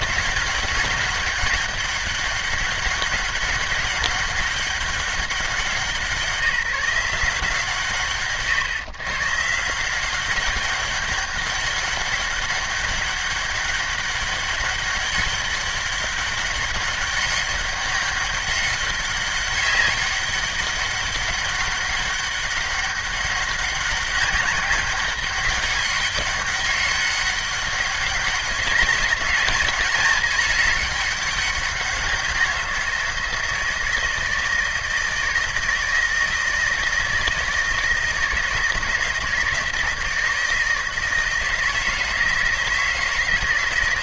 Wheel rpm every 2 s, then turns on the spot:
190, 200, 200, 170, 130, 200, 200, 200, 200, 200, 200, 190, 200, 200, 200, 210, 170, 160, 160, 160, 160, 170.
none